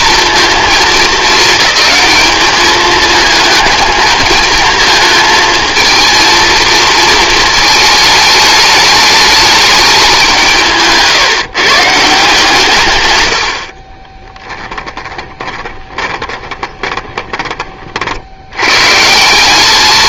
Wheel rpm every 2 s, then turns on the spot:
230, 220, 220, 220, 210, 180, 150, 10, 20, 80.
14-18